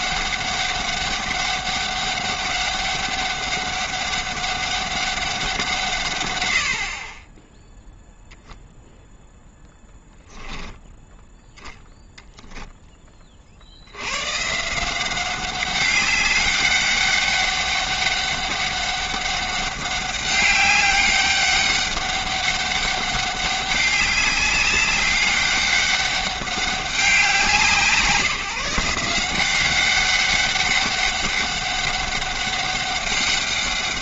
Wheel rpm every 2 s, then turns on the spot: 200, 200, 200, 80, 0, 10, 10, 160, 200, 200, 200, 200, 200, 200, 170, 200, 200.
none